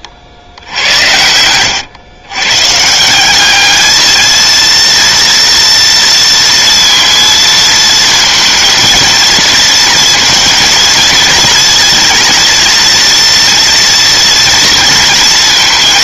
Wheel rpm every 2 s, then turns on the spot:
90, 140, 230, 230, 230, 230, 230, 230.
none